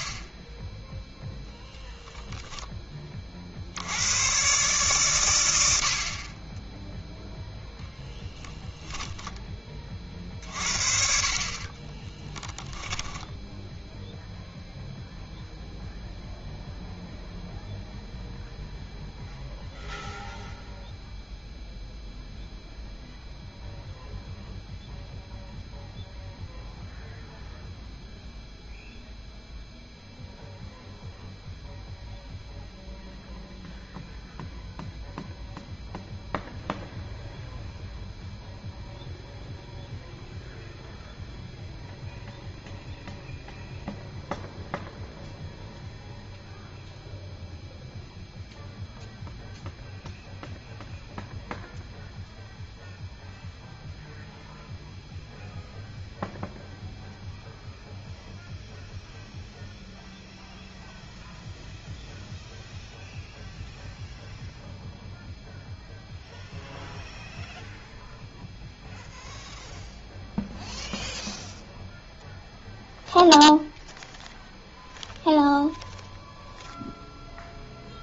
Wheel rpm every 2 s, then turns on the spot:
20, 0, 130, 10, 0, 40, 10, 0, 0, 0, 0, 0, 0, 0, 0, 0, 0, 0, 0, 0, 0, 0, 0, 0, 0, 0, 0, 0, 0, 0, 0, 0, 0, 0, 0, 0, 0, 0, 0.
12-14